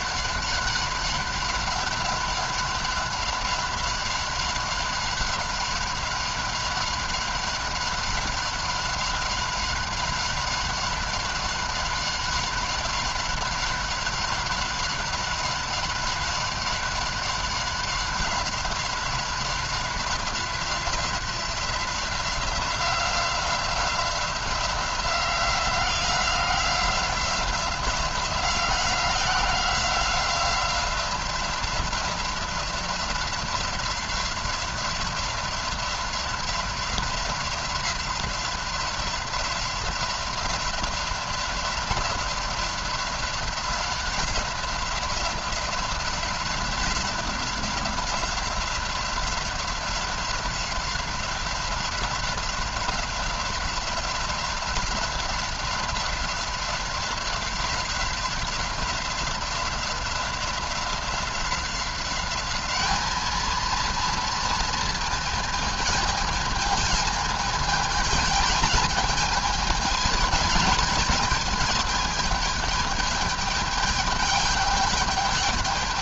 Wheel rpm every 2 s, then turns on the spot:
200, 190, 190, 190, 190, 190, 190, 190, 190, 190, 180, 180, 180, 180, 180, 180, 180, 180, 180, 180, 180, 180, 180, 190, 180, 180, 180, 180, 180, 180, 180, 200, 230, 220, 220, 220, 210, 210.
none